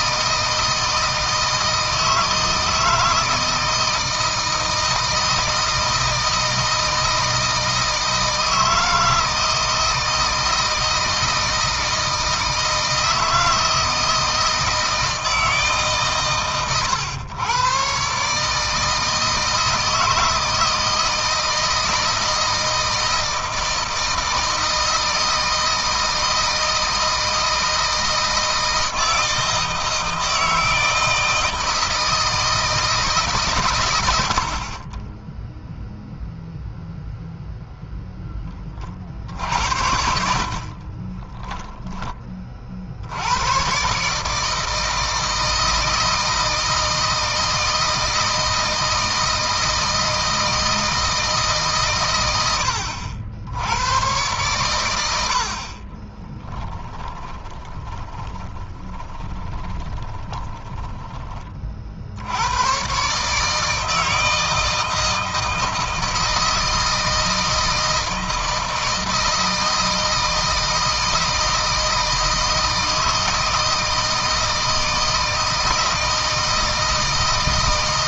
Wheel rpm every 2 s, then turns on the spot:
160, 160, 160, 160, 160, 160, 160, 160, 120, 160, 160, 160, 160, 160, 160, 160, 160, 40, 0, 30, 30, 70, 160, 160, 160, 160, 80, 100, 10, 30, 20, 120, 160, 160, 160, 160, 160, 160, 160.
40-42 56-60